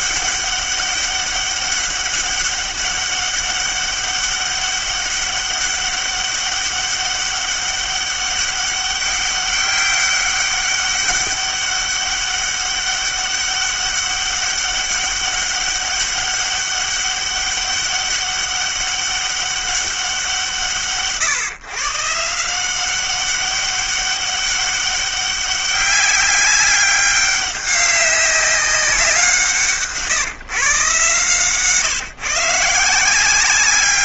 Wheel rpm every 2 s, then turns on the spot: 200, 200, 200, 200, 200, 200, 200, 200, 200, 190, 140, 180, 200, 200, 180, 140, 150.
none